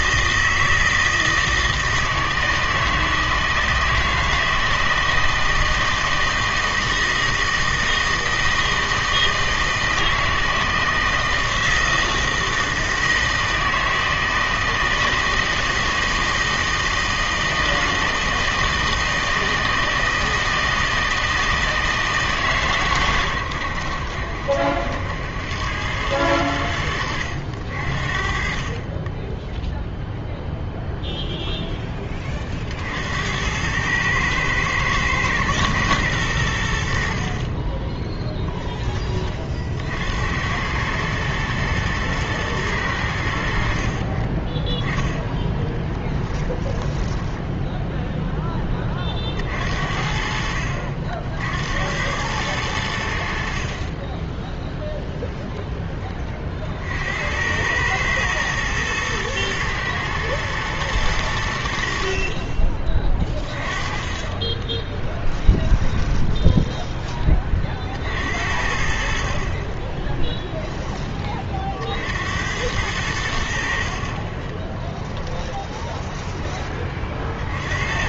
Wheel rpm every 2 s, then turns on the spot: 160, 160, 160, 160, 160, 160, 160, 160, 160, 160, 160, 140, 80, 90, 30, 0, 50, 110, 70, 20, 100, 100, 10, 10, 20, 60, 90, 0, 50, 110, 110, 30, 20, 20, 60, 10, 90, 20, 20.
38-40 46-48 64-68 74-76